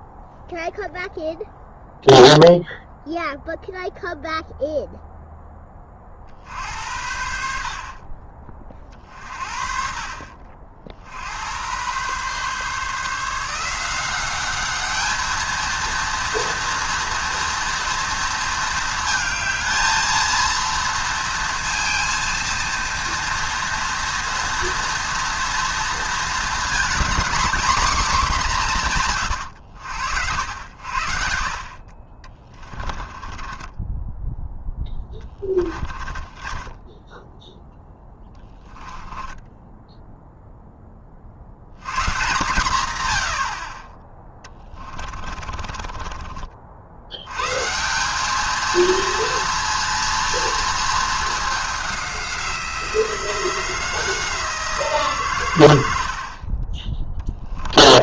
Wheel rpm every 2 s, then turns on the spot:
0, 0, 0, 70, 30, 60, 150, 210, 230, 220, 230, 230, 230, 210, 160, 80, 30, 10, 20, 20, 20, 130, 30, 70, 230, 220, 180, 170, 30.
32-40 44-46